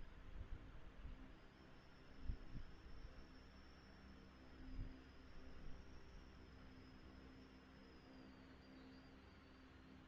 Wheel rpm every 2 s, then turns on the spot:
0, 0, 0, 0, 0.
none